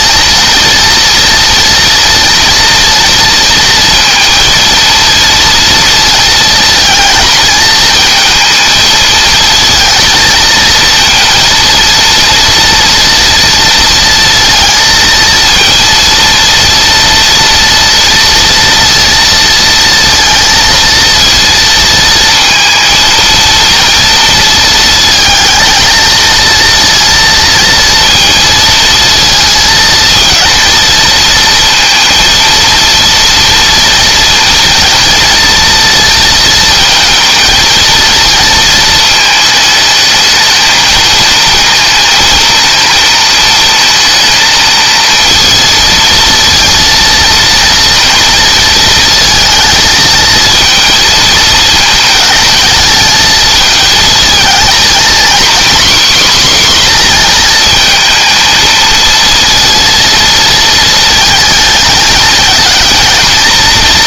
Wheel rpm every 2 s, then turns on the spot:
230, 230, 230, 220, 220, 230, 230, 230, 230, 230, 230, 230, 220, 230, 220, 230, 230, 230, 220, 220, 220, 220, 230, 230, 230, 230, 220, 250, 250, 230, 220, 230.
none